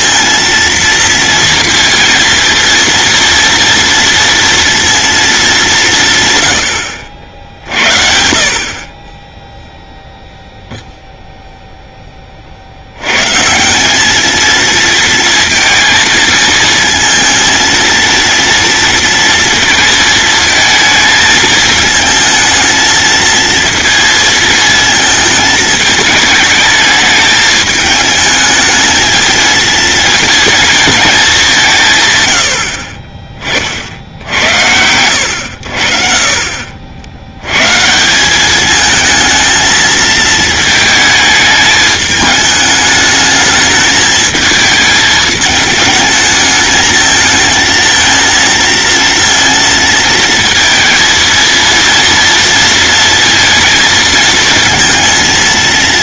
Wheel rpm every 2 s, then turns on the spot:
230, 240, 230, 70, 40, 0, 60, 230, 230, 230, 220, 230, 220, 210, 220, 220, 50, 90, 50, 220, 220, 210, 220, 220, 230, 230, 230, 230.
none